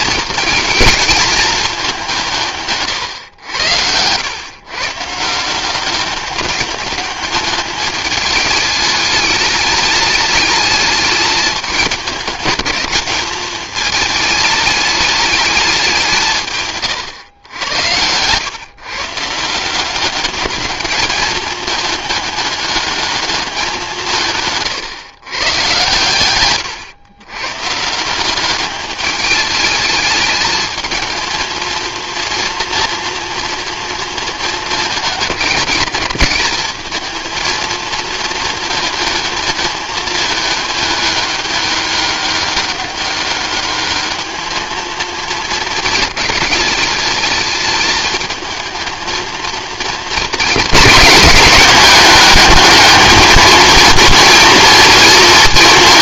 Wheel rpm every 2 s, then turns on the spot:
220, 140, 130, 200, 210, 210, 200, 210, 150, 130, 210, 210, 150, 120, 200, 220, 230, 220, 210, 220, 210, 200, 220, 220, 220, 220, 210, 230.
none